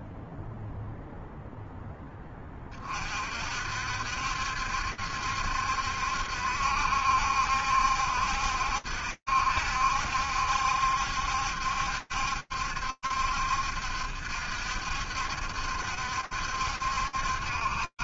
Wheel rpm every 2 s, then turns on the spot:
0, 50, 70, 70, 70, 70, 70, 70, 50.
none